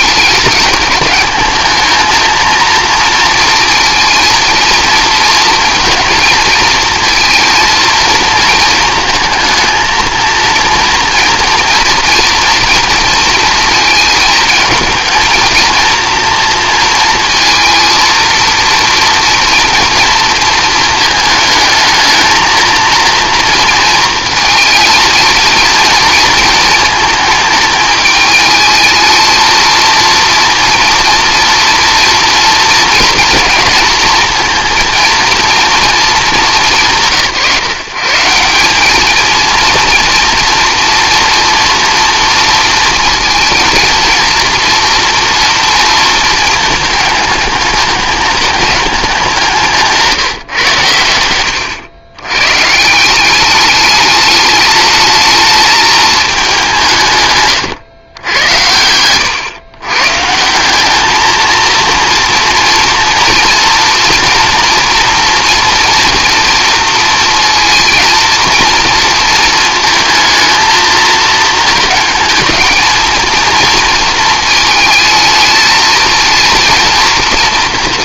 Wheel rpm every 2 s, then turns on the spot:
210, 230, 230, 230, 220, 230, 240, 230, 230, 230, 230, 230, 230, 220, 220, 240, 230, 220, 180, 190, 230, 230, 230, 220, 210, 140, 140, 210, 180, 90, 180, 230, 240, 230, 230, 220, 220, 220, 230.
none